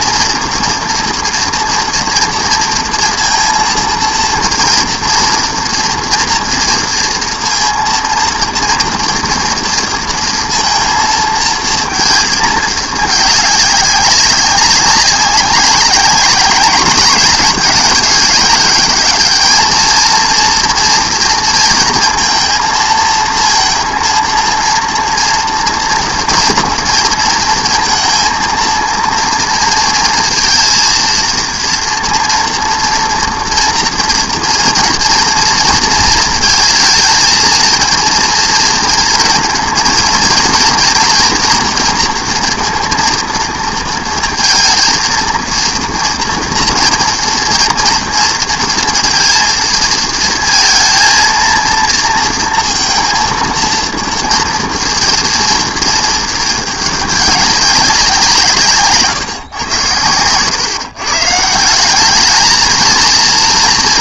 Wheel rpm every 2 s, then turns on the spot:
230, 230, 230, 230, 230, 230, 210, 200, 200, 210, 230, 230, 230, 230, 230, 230, 230, 230, 220, 230, 230, 230, 230, 230, 230, 230, 230, 230, 210, 160, 140, 220.
none